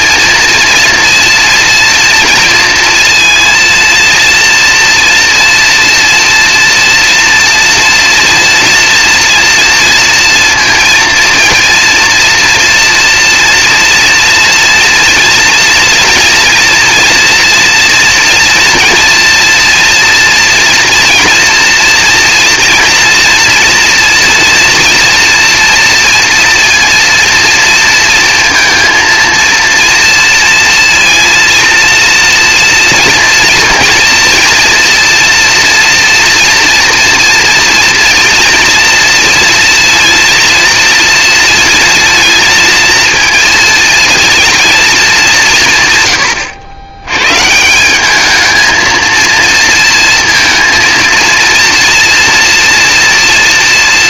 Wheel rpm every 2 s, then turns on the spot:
230, 230, 230, 230, 230, 230, 230, 240, 230, 230, 230, 230, 230, 230, 230, 230, 230, 230, 230, 230, 230, 230, 230, 120, 210, 230, 240.
none